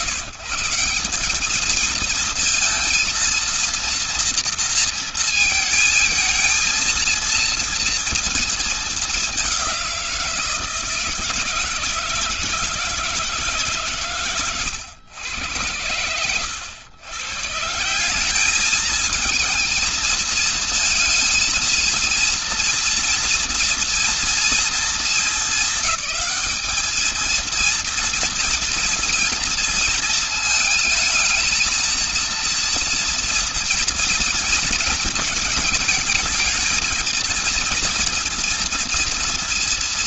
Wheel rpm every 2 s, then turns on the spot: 120, 230, 230, 220, 220, 170, 160, 130, 100, 200, 230, 230, 230, 210, 230, 220, 230, 230, 220, 230.
none